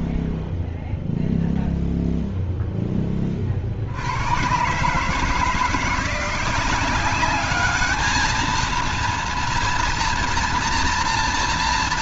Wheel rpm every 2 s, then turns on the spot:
0, 0, 100, 180, 220, 230.
none